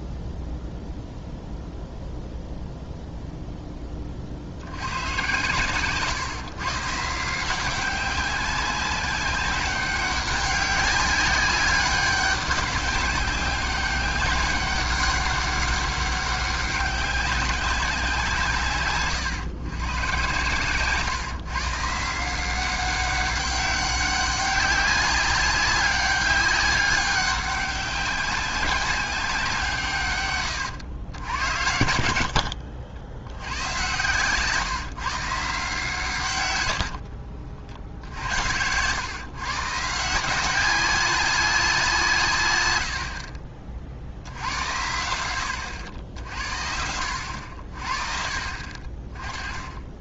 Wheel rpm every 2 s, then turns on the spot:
0, 0, 80, 140, 190, 200, 200, 200, 200, 140, 130, 180, 190, 200, 190, 110, 70, 140, 100, 90, 190, 100, 80, 60, 50.
32-34 36-38 42-44